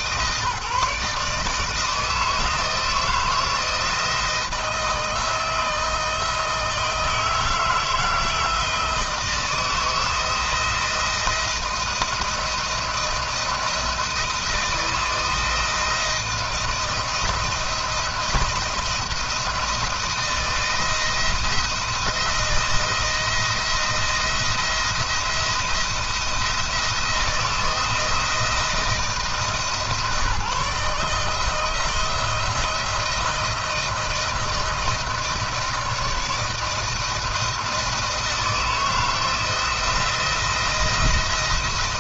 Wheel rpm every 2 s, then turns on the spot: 150, 160, 160, 160, 160, 170, 170, 160, 170, 170, 160, 170, 170, 170, 160, 150, 170, 170, 160, 160, 170.
none